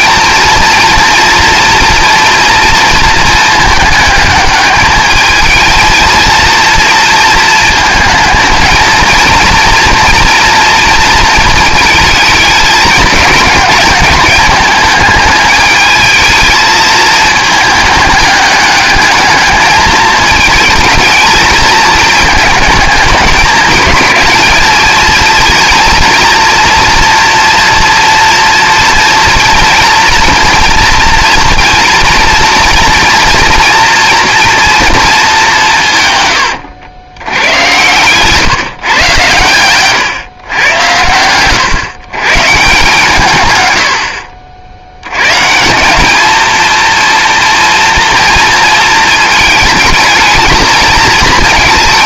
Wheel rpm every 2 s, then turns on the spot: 240, 230, 210, 230, 230, 230, 220, 210, 220, 210, 220, 220, 220, 230, 230, 230, 230, 230, 110, 140, 120, 150, 70, 230, 230, 220.
none